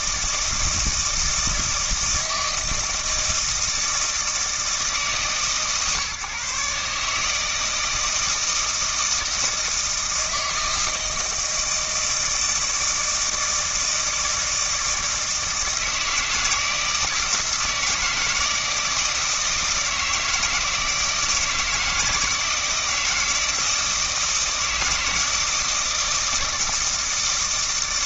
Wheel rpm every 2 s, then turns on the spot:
160, 160, 160, 140, 160, 160, 160, 160, 160, 160, 160, 160, 160, 160.
none